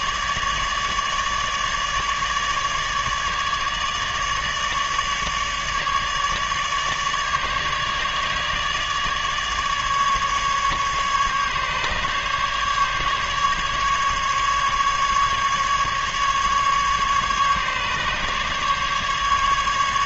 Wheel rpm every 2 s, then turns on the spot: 150, 150, 150, 150, 150, 150, 150, 140, 140, 150.
none